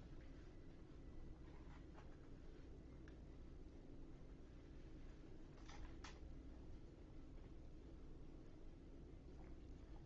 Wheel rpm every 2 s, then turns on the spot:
0, 0, 0, 0, 0.
none